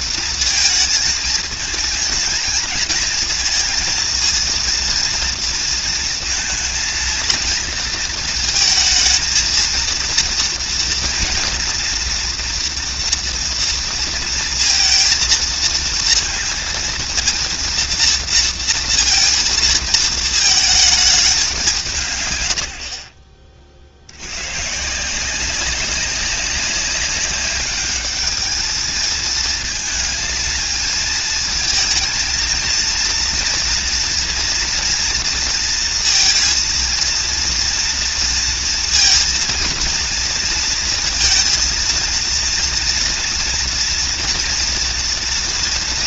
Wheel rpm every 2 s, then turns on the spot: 230, 230, 230, 230, 230, 230, 240, 230, 230, 230, 220, 120, 110, 190, 210, 230, 230, 230, 230, 230, 230, 230, 230.
none